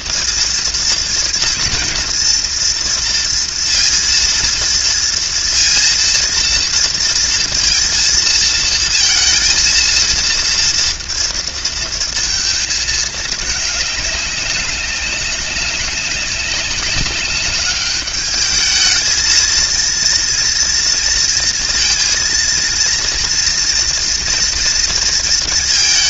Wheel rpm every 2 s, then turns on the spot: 230, 230, 230, 230, 230, 230, 220, 190, 190, 220, 230, 230, 230.
none